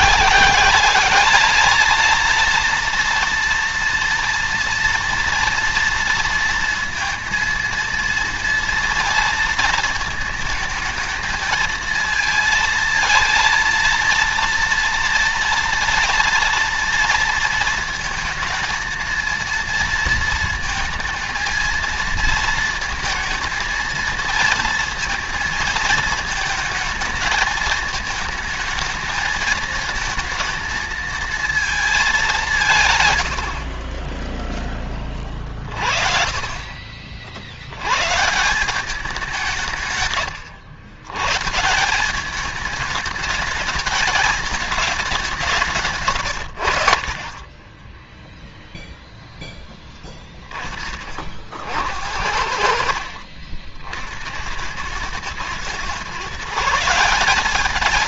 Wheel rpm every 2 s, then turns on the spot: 210, 230, 230, 230, 230, 220, 230, 230, 230, 230, 230, 230, 230, 220, 220, 220, 130, 30, 50, 190, 110, 210, 210, 60, 0, 40, 60, 100, 180.
none